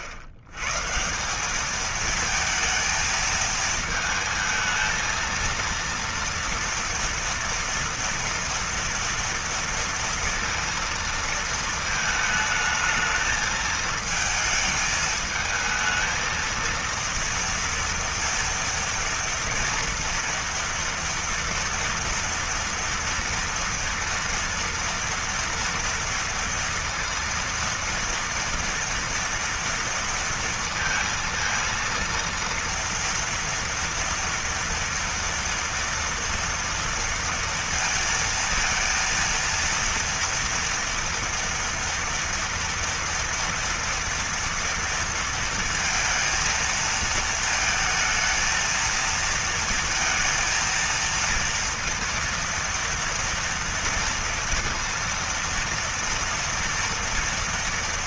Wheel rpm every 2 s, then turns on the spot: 110, 220, 220, 230, 230, 230, 220, 220, 230, 230, 240, 230, 230, 230, 230, 230, 230, 240, 230, 230, 230, 230, 230, 230, 230, 230, 230, 230, 230.
none